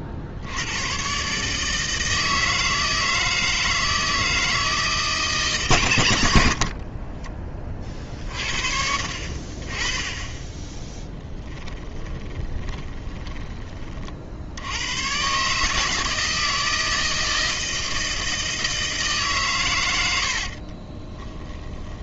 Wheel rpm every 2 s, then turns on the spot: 80, 160, 160, 50, 50, 20, 20, 80, 160, 160, 40.
12-14 20-22